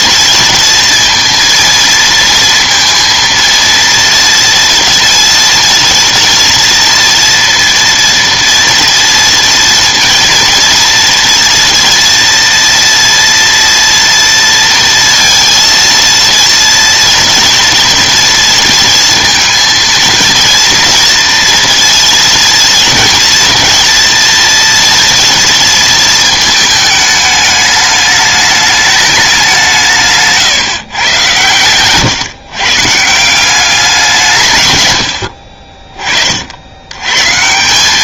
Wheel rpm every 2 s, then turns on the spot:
230, 230, 230, 230, 230, 230, 230, 230, 230, 230, 230, 230, 240, 220, 210, 150, 140, 130, 80.
none